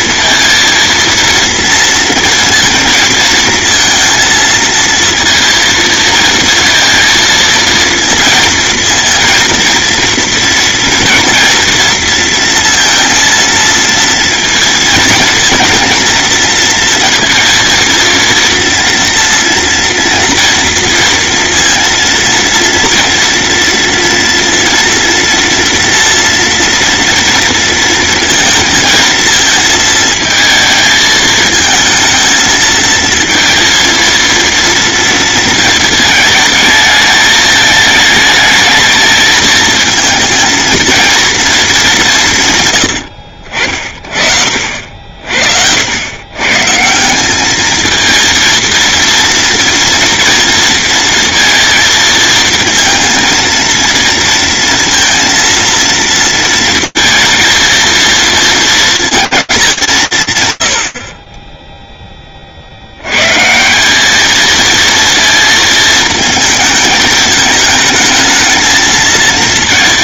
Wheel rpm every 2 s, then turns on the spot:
230, 220, 230, 230, 230, 230, 230, 230, 230, 230, 240, 230, 230, 230, 230, 220, 220, 230, 220, 220, 230, 130, 50, 140, 230, 230, 230, 230, 230, 230, 120, 50, 230, 220, 220.
none